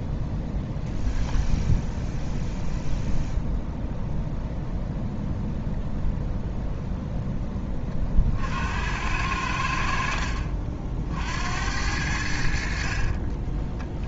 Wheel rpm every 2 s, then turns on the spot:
0, 0, 0, 0, 80, 60, 50.
none